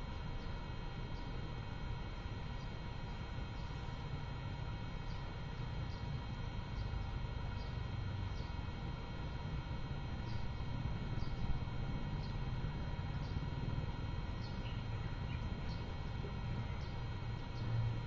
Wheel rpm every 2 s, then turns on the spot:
0, 0, 0, 0, 0, 0, 0, 0, 0.
none